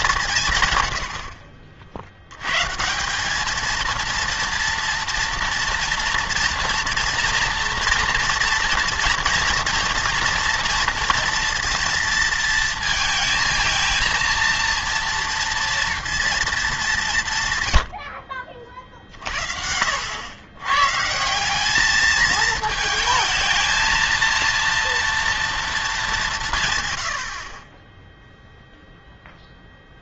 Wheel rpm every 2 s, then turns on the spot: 130, 130, 230, 230, 230, 230, 230, 230, 210, 40, 110, 220, 230, 140, 0.
none